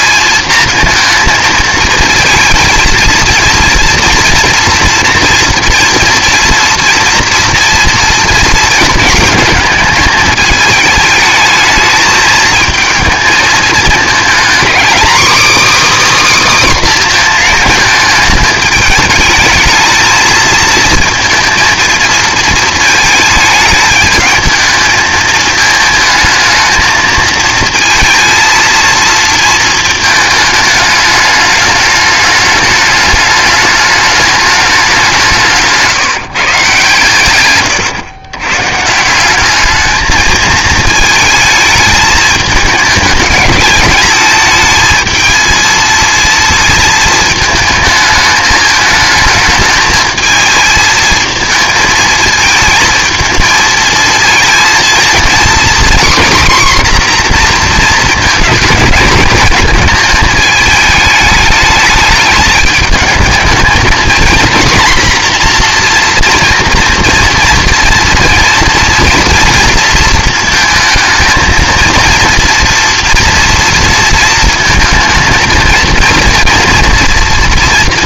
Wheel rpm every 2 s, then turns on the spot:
230, 230, 230, 230, 230, 220, 220, 250, 280, 210, 230, 220, 220, 220, 230, 210, 210, 210, 160, 140, 220, 210, 220, 230, 220, 220, 220, 230, 250, 230, 220, 220, 230, 230, 230, 220, 230, 230, 230.
none